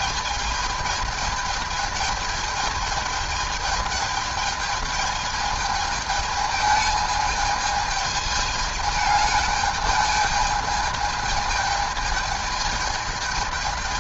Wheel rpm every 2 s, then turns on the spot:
210, 210, 210, 220, 210, 220, 210.
none